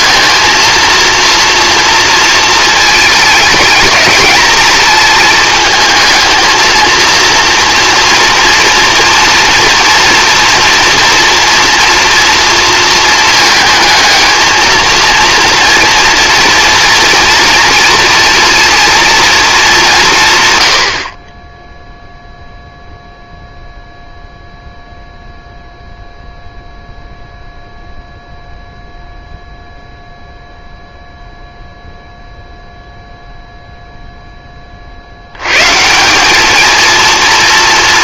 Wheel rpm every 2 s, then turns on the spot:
230, 220, 220, 230, 230, 230, 230, 230, 240, 240, 70, 0, 0, 0, 0, 0, 0, 30, 220.
none